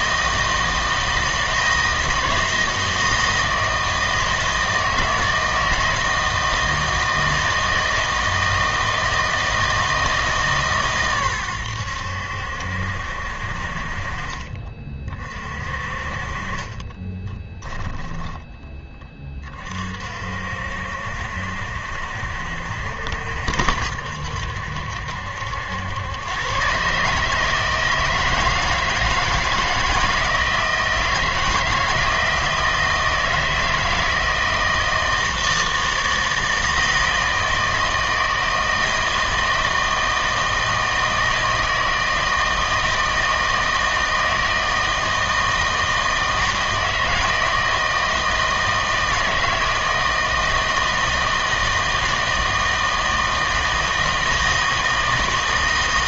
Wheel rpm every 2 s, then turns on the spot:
160, 160, 160, 160, 160, 140, 70, 40, 30, 10, 60, 70, 70, 120, 160, 160, 160, 160, 160, 160, 160, 160, 160, 160, 160, 160, 160, 160.
none